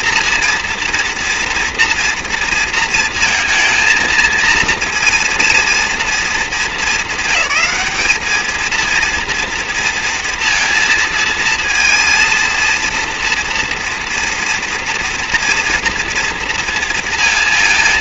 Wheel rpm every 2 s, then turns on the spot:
230, 230, 230, 220, 210, 230, 230, 230, 230.
none